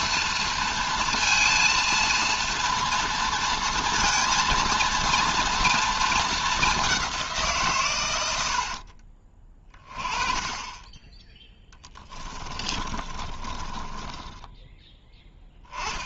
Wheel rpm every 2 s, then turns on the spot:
230, 230, 230, 190, 40, 20, 20, 10.
8-10 12-14